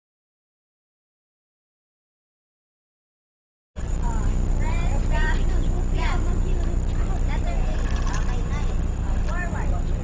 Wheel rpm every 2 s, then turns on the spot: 0, 160, 30, 0, 20.
4-6 8-10